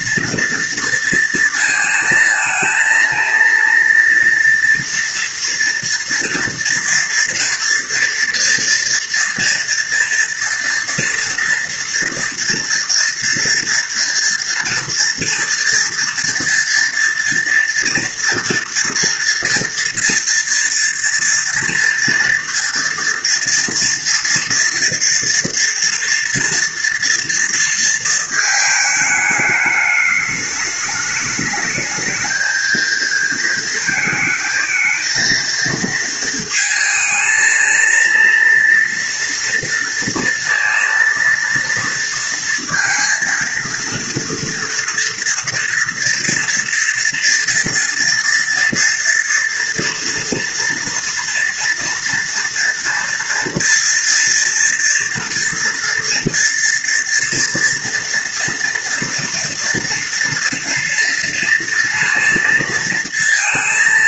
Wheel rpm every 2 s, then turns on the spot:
230, 230, 230, 230, 230, 240, 230, 230, 230, 230, 230, 230, 240, 230, 230, 210, 220, 220, 230, 230, 230, 230, 230, 240, 230, 230, 230, 230, 230, 230, 230, 230.
none